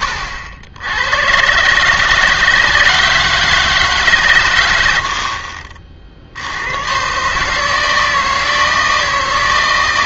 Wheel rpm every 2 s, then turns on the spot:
80, 160, 110, 110, 160.
none